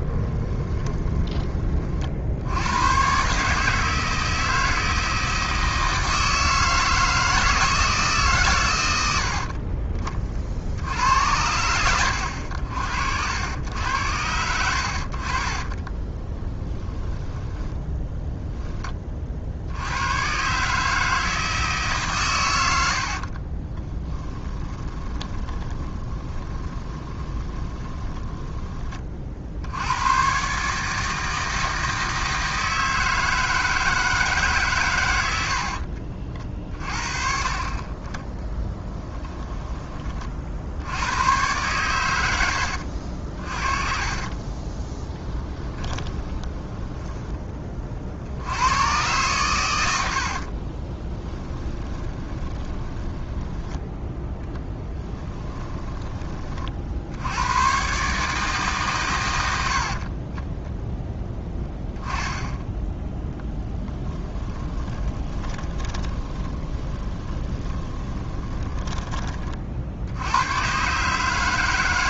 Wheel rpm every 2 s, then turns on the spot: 20, 110, 160, 160, 100, 70, 80, 60, 10, 20, 150, 80, 20, 20, 20, 150, 160, 120, 40, 10, 80, 70, 20, 10, 110, 30, 20, 10, 60, 130, 0, 10, 30, 20, 10, 140.
0-2 16-18 22-28 38-40 42-48 50-56 64-70